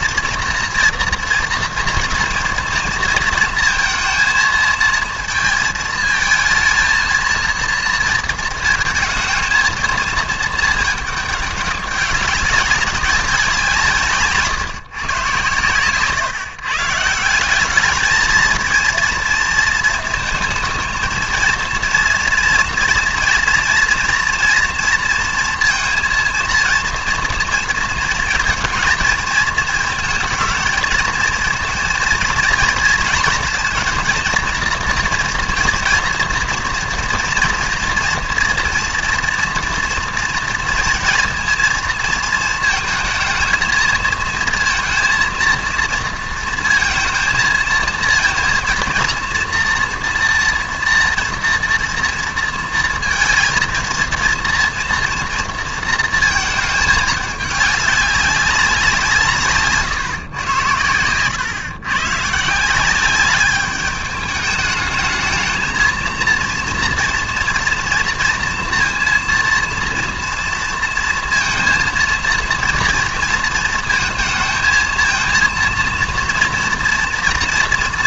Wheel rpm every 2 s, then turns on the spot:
230, 230, 230, 230, 220, 220, 200, 150, 150, 230, 220, 230, 230, 230, 230, 220, 230, 230, 230, 230, 230, 220, 220, 230, 230, 230, 230, 230, 220, 190, 110, 160, 210, 230, 230, 230, 230, 220, 230.
none